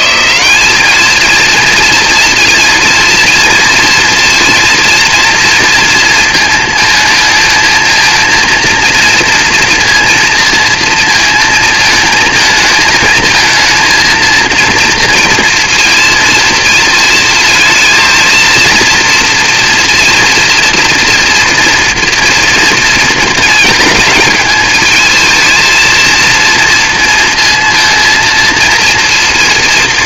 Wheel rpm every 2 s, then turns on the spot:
200, 230, 230, 230, 230, 230, 230, 230, 230, 230, 230, 230, 220, 230, 230.
none